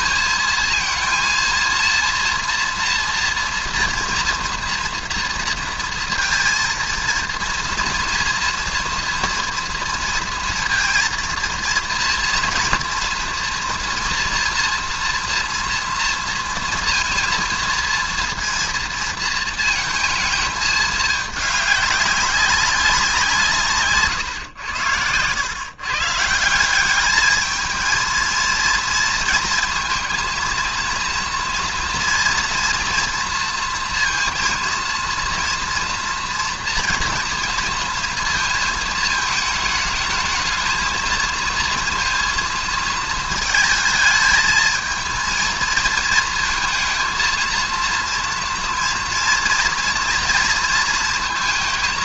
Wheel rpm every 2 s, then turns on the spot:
220, 230, 240, 230, 230, 230, 230, 230, 230, 230, 220, 190, 100, 170, 230, 230, 230, 230, 230, 220, 220, 220, 220, 230, 230, 230.
none